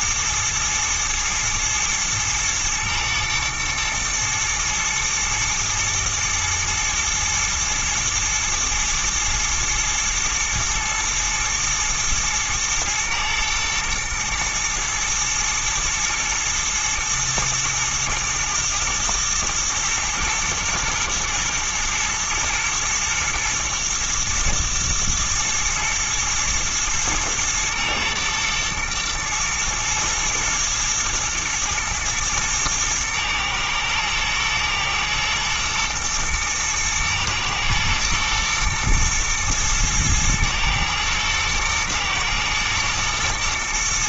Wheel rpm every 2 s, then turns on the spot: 120, 110, 110, 110, 110, 110, 110, 120, 110, 110, 120, 110, 120, 120, 110, 120, 110, 110, 120, 110, 110, 110.
none